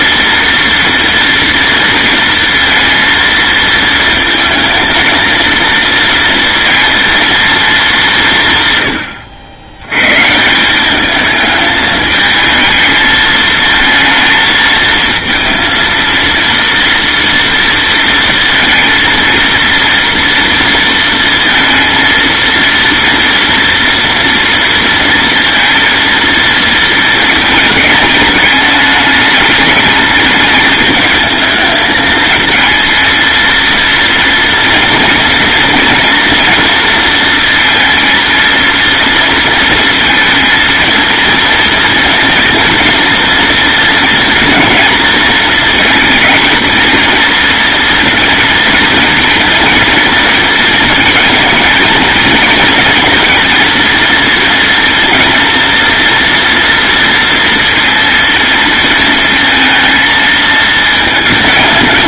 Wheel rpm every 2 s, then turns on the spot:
230, 230, 230, 230, 110, 200, 220, 230, 230, 230, 230, 230, 230, 220, 210, 210, 220, 230, 230, 230, 230, 230, 230, 230, 230, 230, 230, 240, 230, 220, 220.
none